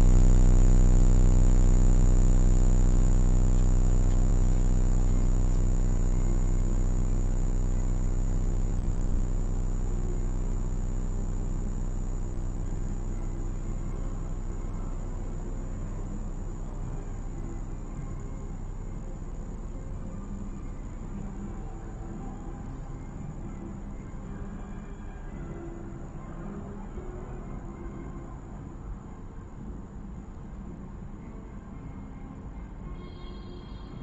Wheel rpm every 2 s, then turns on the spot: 0, 0, 0, 0, 0, 0, 0, 0, 0, 0, 0, 0, 0, 0, 0, 0, 0.
none